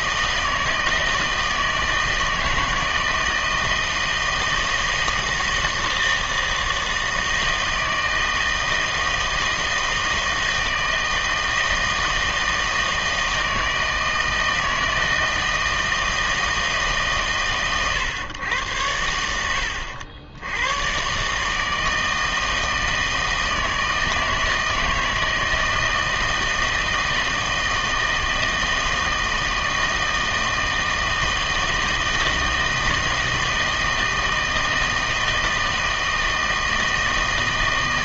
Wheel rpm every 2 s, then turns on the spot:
160, 160, 160, 160, 160, 160, 160, 160, 150, 100, 90, 160, 160, 160, 160, 160, 160, 160, 160.
none